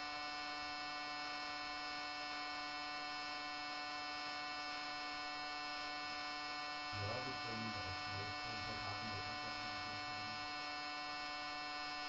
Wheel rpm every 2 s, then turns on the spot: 0, 0, 0, 0, 0, 0.
none